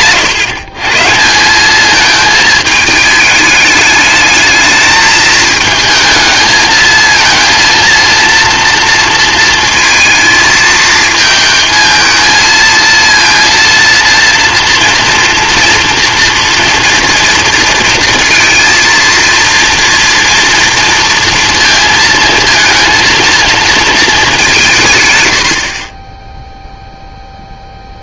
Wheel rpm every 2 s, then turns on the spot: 140, 220, 220, 220, 230, 230, 230, 230, 230, 230, 230, 230, 170, 0.
none